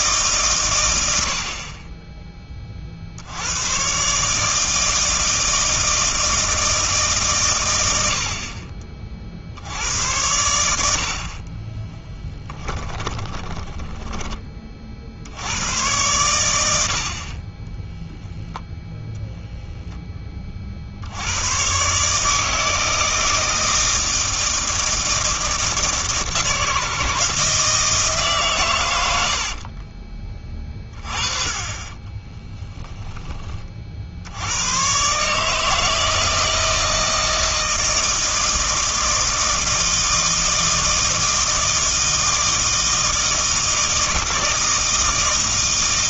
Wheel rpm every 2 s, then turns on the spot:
120, 40, 160, 160, 40, 80, 20, 30, 80, 0, 50, 160, 160, 160, 120, 30, 10, 100, 160, 160, 160, 160, 160.
12-14 32-34